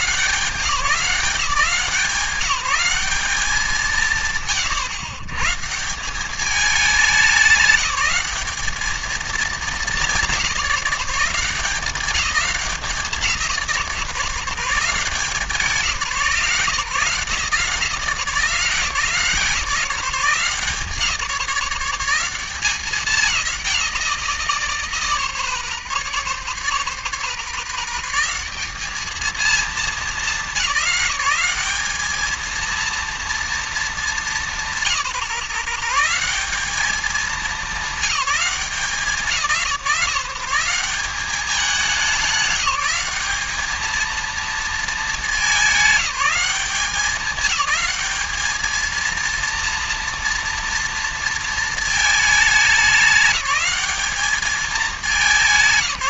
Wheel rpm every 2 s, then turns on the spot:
180, 200, 130, 200, 210, 180, 170, 170, 150, 140, 140, 180, 140, 110, 200, 190, 230, 170, 210, 190, 190, 190, 220, 200, 220, 230, 190, 210.
none